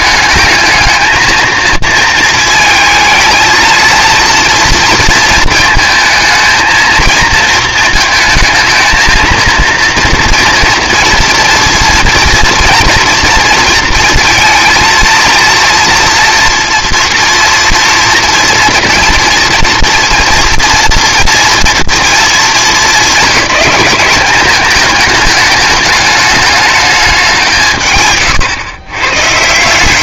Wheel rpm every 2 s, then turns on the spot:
220, 230, 230, 230, 230, 230, 240, 230, 230, 230, 240, 200, 210, 210, 120.
none